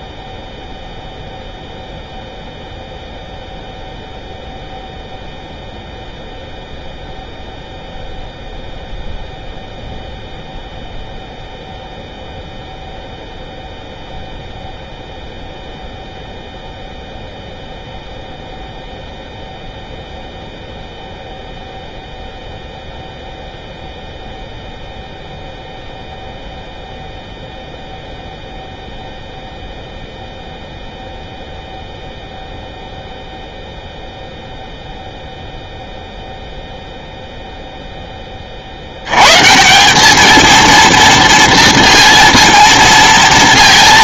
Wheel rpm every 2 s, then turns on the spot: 0, 0, 0, 0, 0, 0, 0, 0, 0, 0, 0, 0, 0, 0, 0, 0, 0, 0, 0, 50, 220, 230.
none